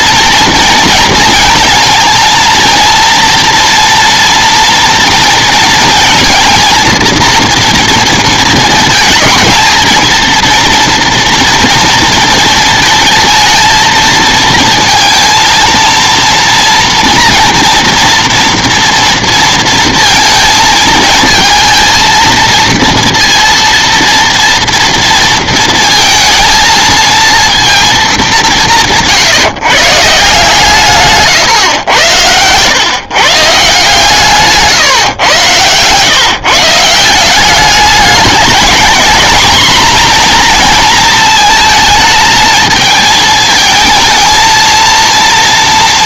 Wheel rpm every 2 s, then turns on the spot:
230, 230, 230, 230, 220, 230, 230, 230, 230, 230, 230, 230, 230, 220, 190, 160, 120, 140, 150, 220, 240, 220, 230.
none